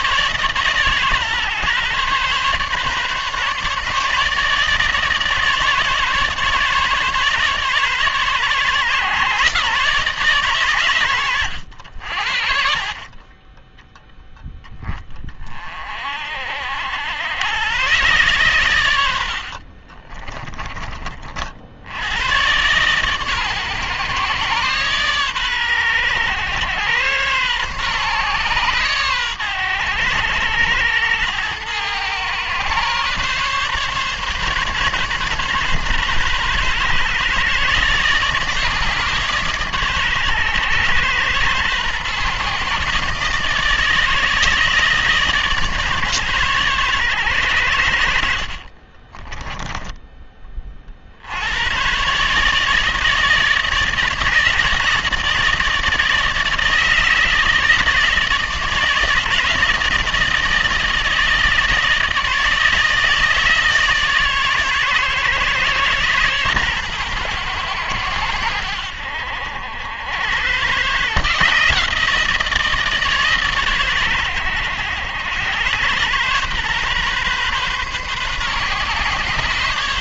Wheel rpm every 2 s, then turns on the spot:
140, 140, 160, 140, 140, 130, 50, 10, 60, 100, 20, 120, 130, 100, 120, 100, 130, 140, 130, 150, 110, 140, 150, 130, 50, 40, 160, 160, 160, 160, 160, 160, 140, 130, 80, 130, 160, 90, 130, 140.
48-50